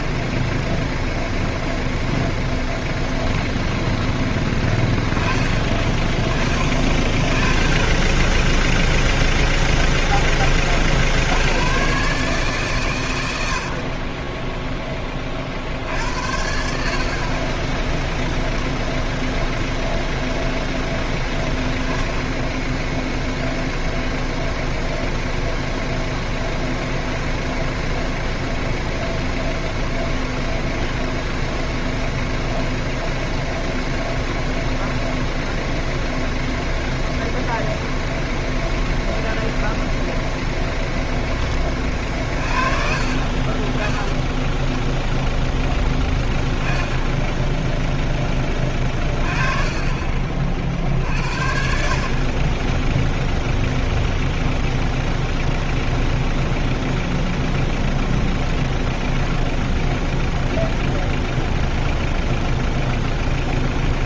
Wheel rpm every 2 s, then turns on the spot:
0, 10, 10, 30, 0, 30, 130, 10, 50, 0, 0, 10, 0, 0, 0, 0, 0, 0, 0, 0, 0, 40, 10, 10, 20, 60, 10, 0, 0, 0, 0, 0.
2-4 48-50